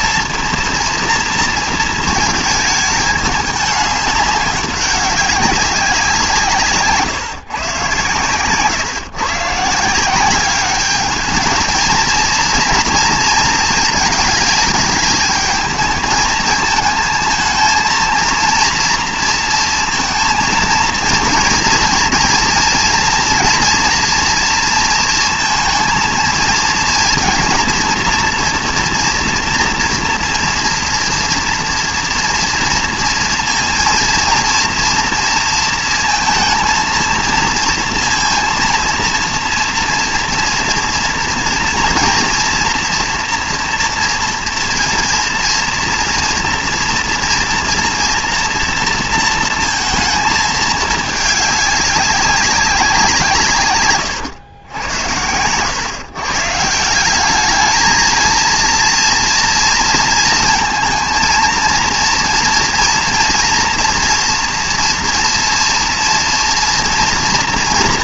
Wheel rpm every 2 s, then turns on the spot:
230, 220, 190, 150, 130, 200, 230, 220, 220, 230, 230, 230, 230, 230, 230, 230, 230, 230, 220, 230, 230, 230, 240, 230, 230, 210, 190, 90, 170, 230, 230, 230, 230, 230.
none